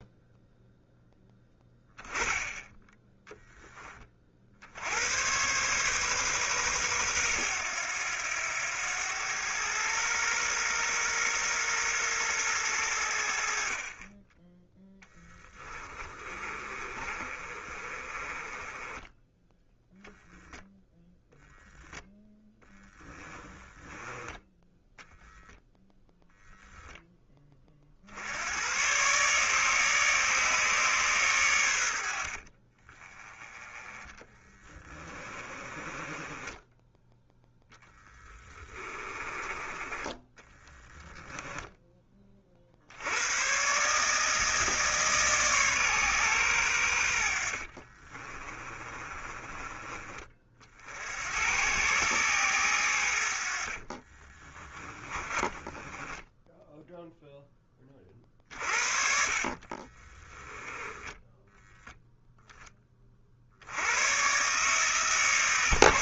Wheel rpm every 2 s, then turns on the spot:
0, 10, 80, 110, 100, 120, 100, 10, 30, 20, 0, 10, 0, 10, 120, 140, 30, 20, 10, 20, 10, 70, 150, 90, 30, 60, 100, 20, 0, 50, 10, 30, 140.
16-20 22-24 34-36 38-42 48-50 54-56 60-62